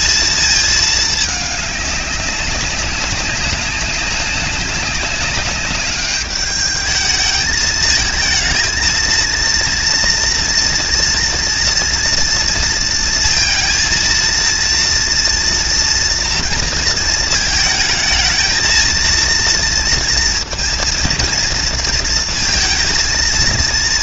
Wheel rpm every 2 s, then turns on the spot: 220, 200, 200, 210, 220, 230, 230, 230, 230, 220, 230, 230.
none